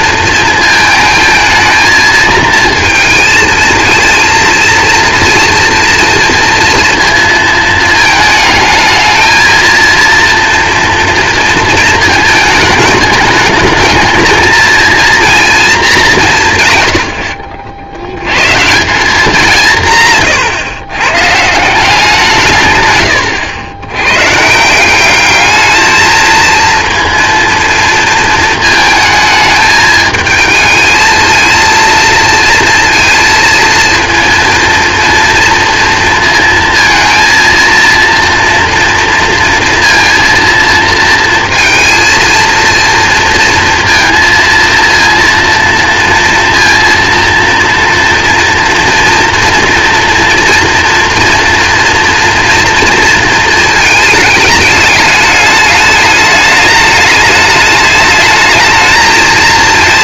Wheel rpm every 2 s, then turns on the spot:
220, 230, 230, 230, 220, 240, 210, 230, 120, 150, 130, 130, 170, 230, 220, 220, 230, 230, 230, 230, 230, 230, 230, 230, 240, 230, 230, 210, 210, 220.
22-24